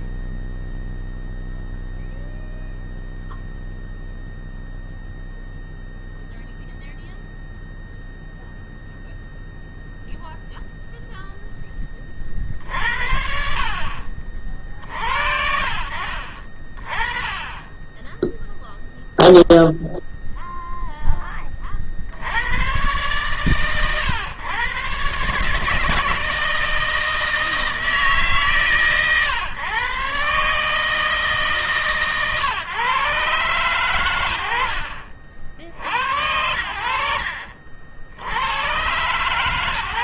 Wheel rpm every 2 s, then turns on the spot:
0, 0, 0, 0, 0, 0, 30, 50, 40, 0, 0, 60, 120, 160, 140, 130, 130, 90, 80, 90.
none